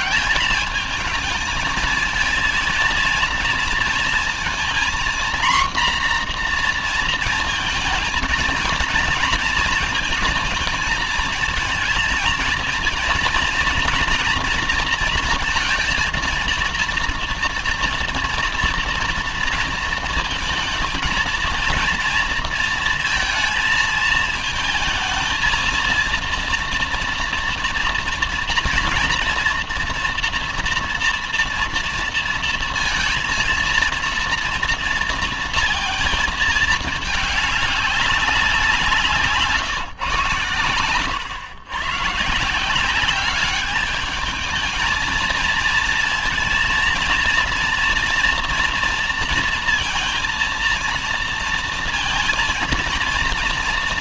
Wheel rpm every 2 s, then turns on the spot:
200, 230, 230, 240, 230, 220, 220, 230, 230, 230, 220, 230, 220, 230, 230, 240, 230, 230, 220, 180, 110, 160, 220, 230, 230, 230, 230.
none